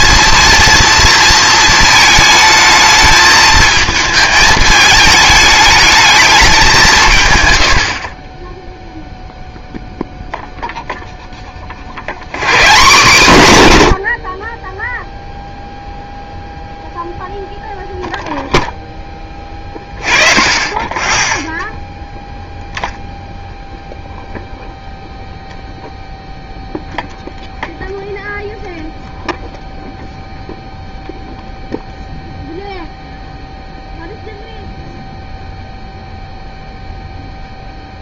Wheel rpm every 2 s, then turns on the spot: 230, 220, 210, 190, 10, 0, 150, 30, 0, 0, 20, 0, 0, 0, 0, 0, 0, 0, 0.
none